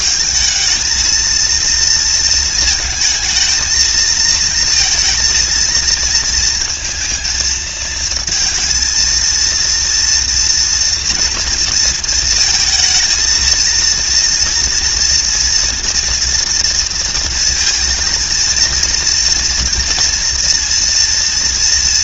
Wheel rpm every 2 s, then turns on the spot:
220, 220, 230, 230, 230, 230, 230, 230, 230, 230, 230.
none